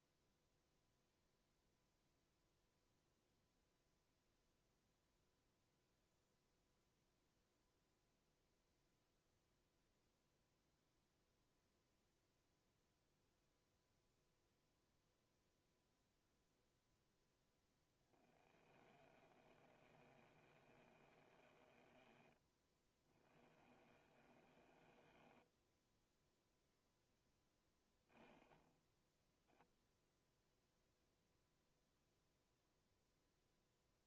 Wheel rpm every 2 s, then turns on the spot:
0, 0, 0, 0, 0, 0, 0, 0, 0, 30, 30, 20, 20, 0, 10, 0, 0.
18-26